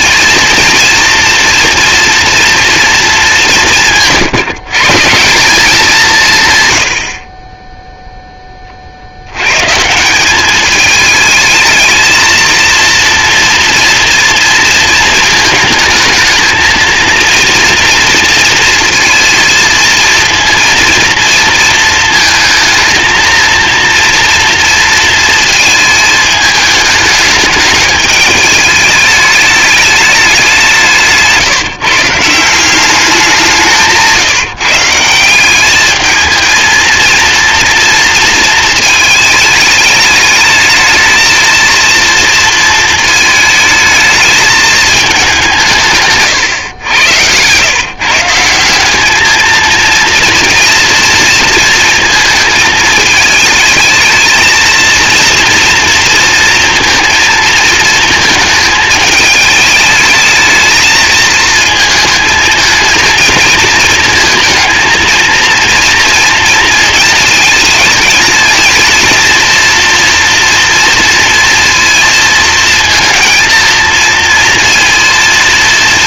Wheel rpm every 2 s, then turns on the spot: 230, 230, 140, 110, 40, 210, 230, 230, 230, 230, 230, 230, 230, 210, 210, 180, 180, 160, 220, 220, 220, 220, 220, 110, 190, 240, 220, 230, 230, 220, 220, 230, 220, 230, 230, 230, 230, 230.
none